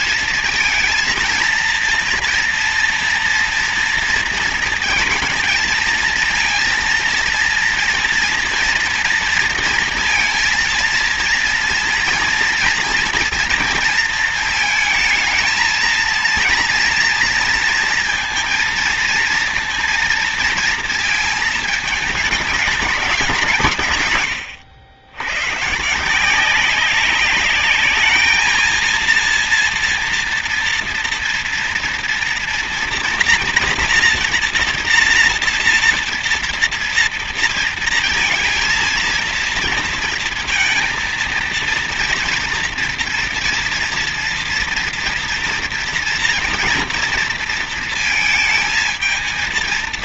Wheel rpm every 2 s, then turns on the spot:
230, 230, 230, 230, 230, 230, 230, 230, 230, 230, 230, 220, 110, 180, 220, 230, 230, 230, 230, 230, 230, 230, 230, 230, 220.
none